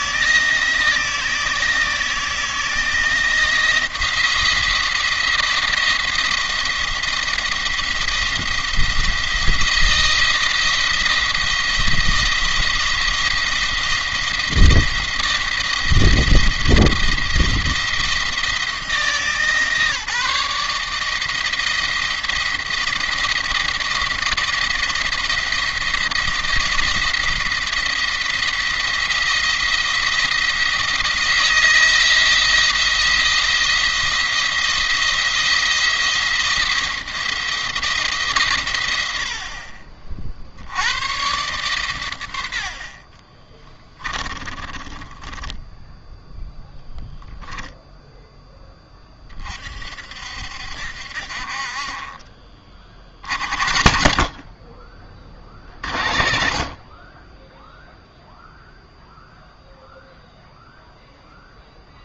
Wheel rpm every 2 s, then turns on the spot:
160, 160, 170, 170, 170, 170, 170, 170, 170, 160, 160, 170, 170, 170, 170, 160, 170, 170, 170, 110, 70, 80, 20, 0, 20, 60, 40, 40, 50, 0, 0.
44-46